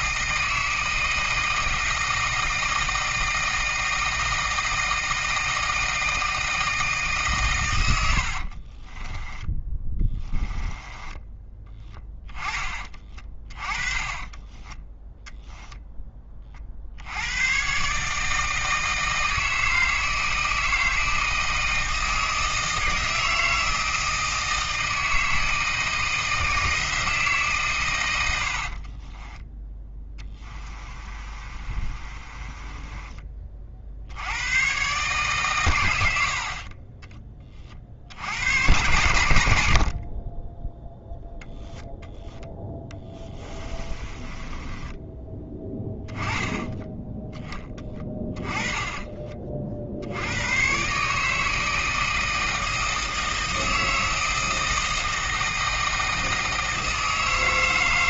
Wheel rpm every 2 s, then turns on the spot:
160, 160, 160, 160, 30, 10, 20, 10, 60, 160, 160, 160, 160, 160, 40, 20, 20, 130, 30, 120, 10, 20, 20, 10, 20, 130, 160, 160, 160.
8-16 28-34 42-50